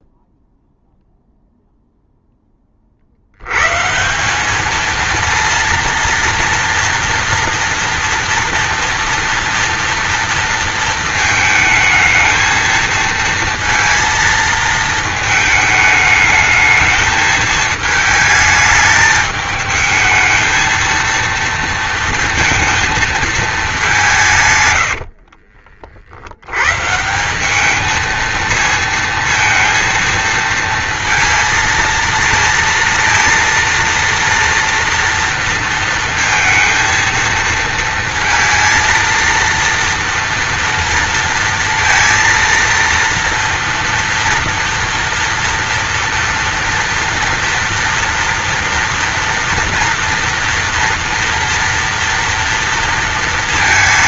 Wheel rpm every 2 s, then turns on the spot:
0, 60, 230, 230, 230, 230, 230, 220, 220, 210, 230, 220, 70, 160, 220, 230, 230, 230, 230, 230, 230, 230, 230, 230, 230, 230, 230.
24-26